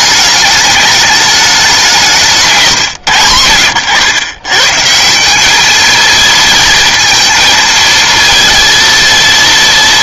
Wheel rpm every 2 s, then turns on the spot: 210, 150, 140, 230, 230.
none